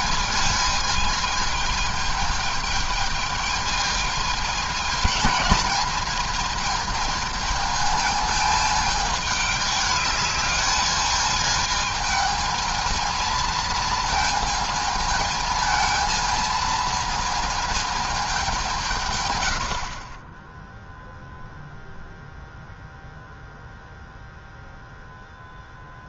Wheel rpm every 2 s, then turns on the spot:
220, 220, 210, 220, 210, 210, 220, 220, 220, 160, 0, 0, 0.
none